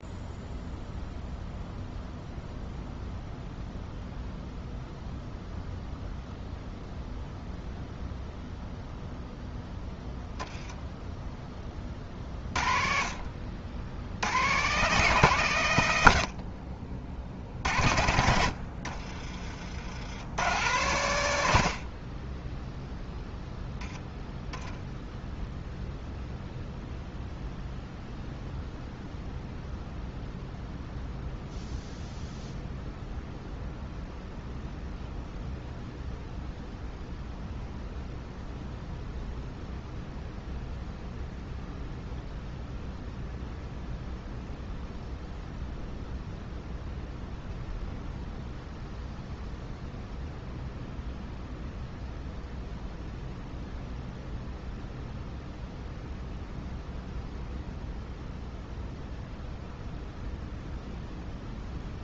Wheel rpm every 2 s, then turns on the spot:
0, 0, 0, 0, 0, 10, 50, 150, 60, 40, 110, 0, 0, 0, 0, 0, 0, 0, 0, 0, 0, 0, 0, 0, 0, 0, 0, 0, 0, 0, 0.
18-20